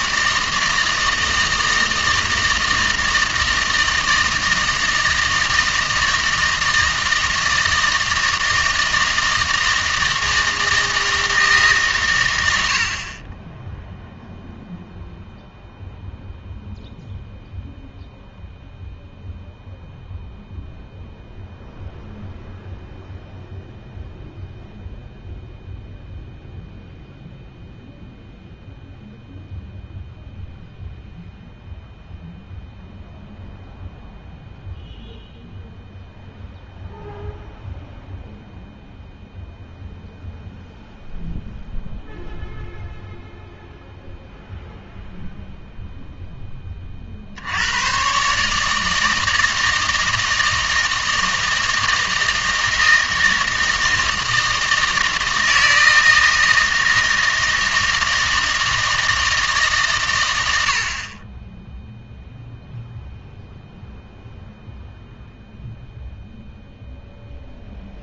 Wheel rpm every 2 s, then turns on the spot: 160, 160, 160, 160, 160, 160, 80, 0, 0, 0, 0, 0, 0, 0, 0, 0, 0, 0, 0, 0, 0, 0, 0, 20, 150, 160, 160, 160, 160, 160, 70, 0, 0, 0.
none